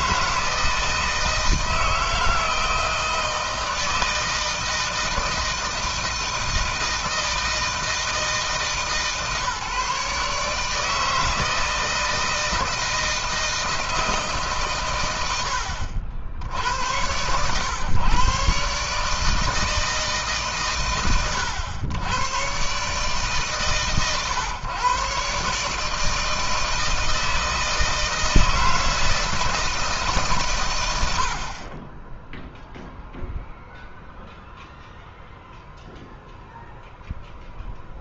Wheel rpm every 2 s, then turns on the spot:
160, 160, 160, 160, 160, 150, 160, 140, 70, 140, 140, 120, 130, 160, 160, 130, 10, 0, 0.
none